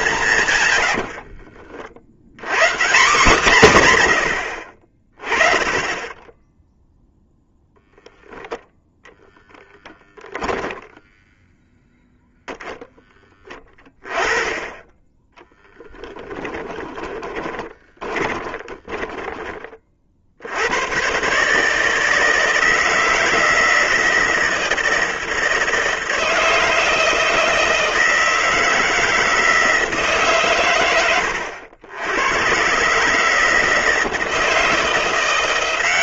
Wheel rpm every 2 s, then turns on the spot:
90, 170, 40, 0, 0, 10, 10, 10, 10, 10, 120, 160, 160, 160, 160, 100, 150, 170.
0-2 10-12 16-20